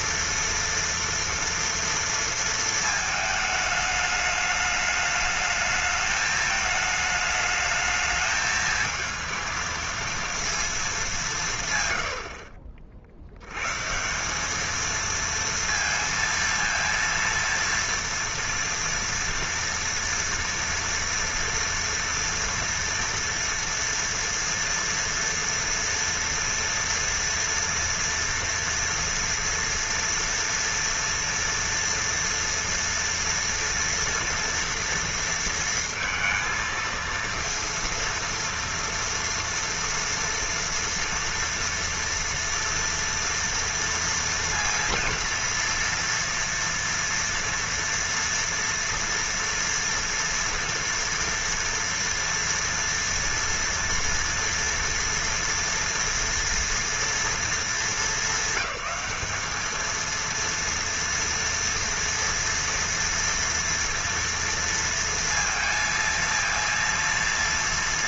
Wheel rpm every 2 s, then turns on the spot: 230, 230, 210, 220, 220, 230, 40, 210, 230, 230, 230, 230, 240, 240, 230, 240, 230, 230, 230, 230, 230, 230, 230, 230, 230, 230, 230, 230, 230, 190, 230, 230, 230, 230.
12-14